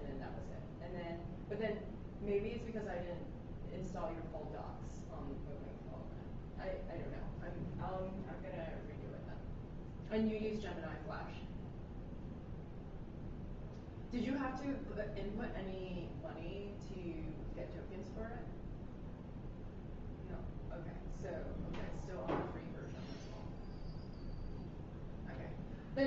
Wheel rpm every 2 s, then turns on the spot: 0, 0, 0, 0, 0, 0, 0, 0, 0, 0, 0, 0, 0.
none